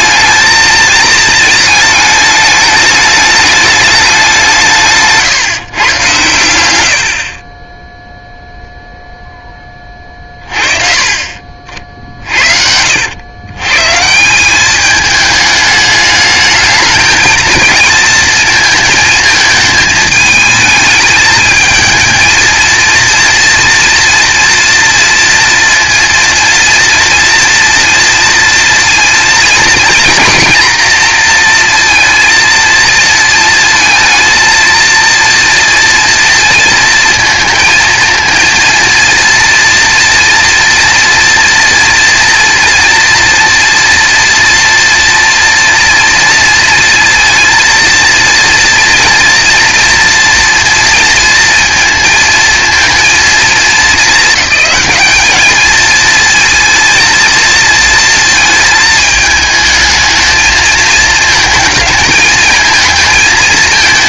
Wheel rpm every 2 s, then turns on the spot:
230, 210, 170, 100, 0, 40, 60, 190, 220, 230, 220, 230, 240, 230, 230, 240, 230, 230, 230, 230, 230, 230, 230, 230, 230, 230, 230, 210, 230, 220, 220, 220.
none